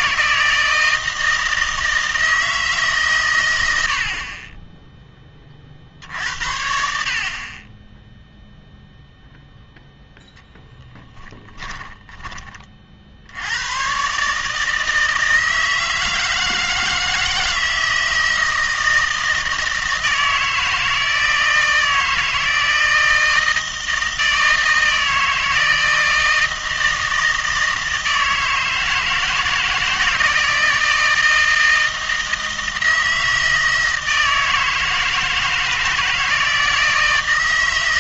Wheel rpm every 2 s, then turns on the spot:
160, 160, 10, 70, 0, 10, 30, 150, 160, 160, 160, 160, 160, 160, 160, 160, 160, 160, 160.
10-12